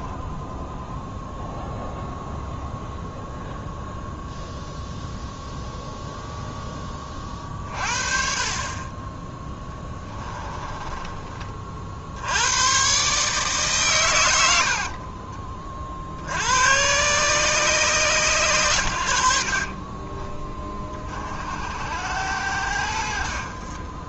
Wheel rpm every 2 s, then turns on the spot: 10, 0, 0, 10, 30, 20, 110, 90, 90, 110, 40, 90.
0-2 10-12 14-16